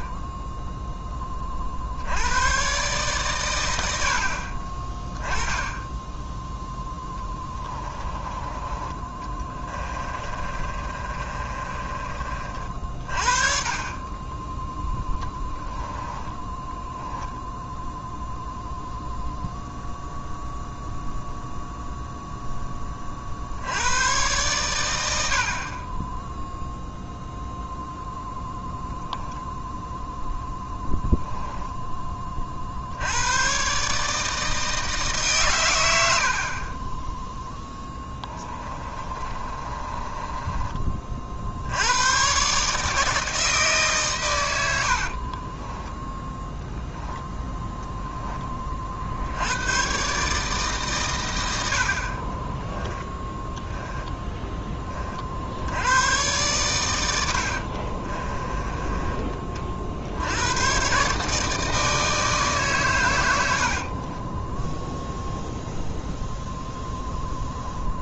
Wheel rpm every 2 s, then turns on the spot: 10, 120, 20, 20, 20, 30, 50, 10, 0, 0, 0, 30, 100, 0, 0, 10, 80, 150, 10, 30, 30, 150, 70, 10, 50, 130, 10, 40, 100, 20, 130, 120, 0, 0.
6-12 14-16 30-32 36-40 44-46 52-54 58-60